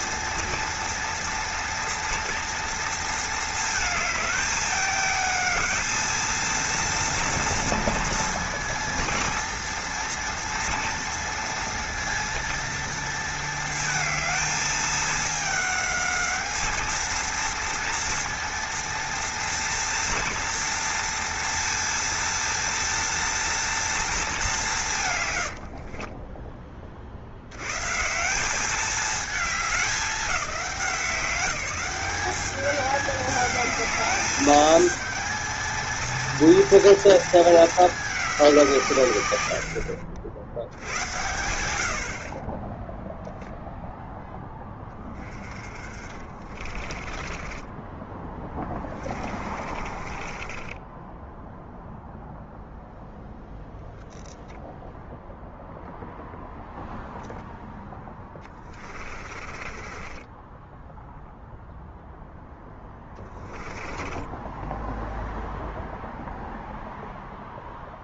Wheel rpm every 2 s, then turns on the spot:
230, 230, 210, 230, 230, 230, 230, 220, 220, 230, 230, 230, 170, 30, 200, 190, 210, 220, 230, 170, 80, 10, 10, 30, 20, 20, 0, 0, 0, 20, 10, 10, 10, 0.
46-52 58-66